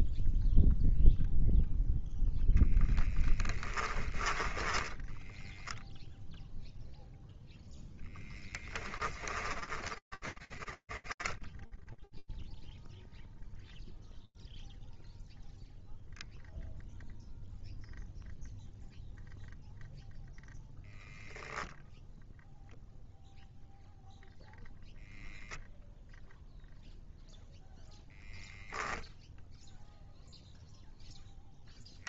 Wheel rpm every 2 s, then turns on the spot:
0, 0, 10, 0, 0, 20, 0, 0, 0, 0, 0, 0, 0, 0, 0, 10.
4-6 10-12